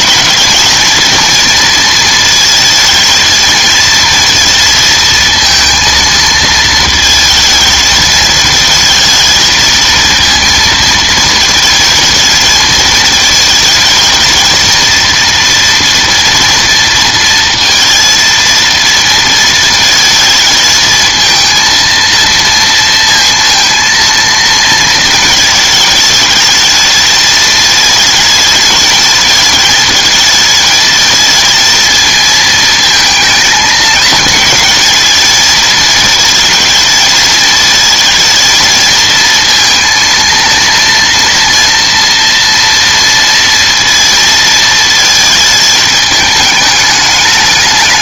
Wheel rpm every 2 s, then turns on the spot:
220, 230, 230, 220, 220, 230, 220, 220, 230, 230, 220, 230, 230, 220, 220, 220, 220, 220, 220, 230, 230, 230, 230, 210.
none